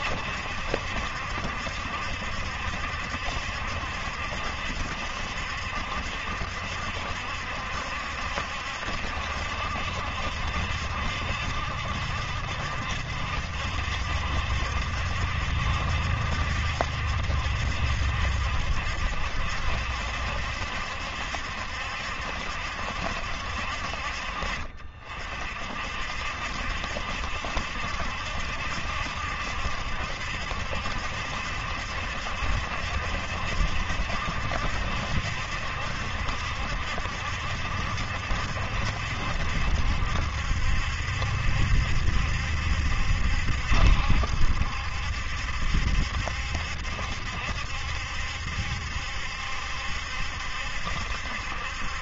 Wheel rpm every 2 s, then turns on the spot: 70, 70, 70, 70, 70, 70, 70, 70, 70, 70, 70, 70, 50, 70, 70, 70, 70, 70, 70, 70, 70, 70, 70, 70, 70, 70.
none